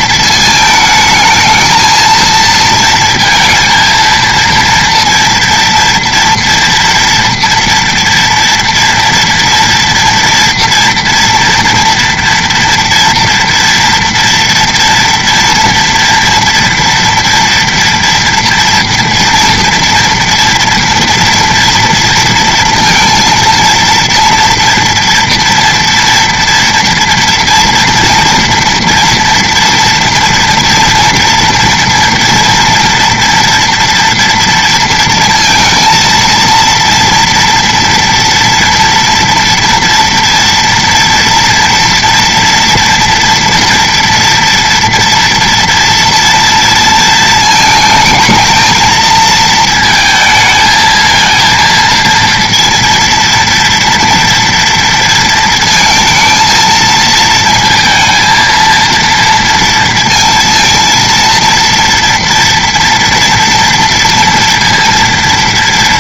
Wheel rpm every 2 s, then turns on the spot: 220, 230, 230, 230, 230, 230, 230, 230, 230, 240, 240, 230, 230, 230, 230, 230, 230, 230, 230, 230, 230, 230, 230, 230, 220, 220, 230, 230, 220, 230, 230, 230, 230.
none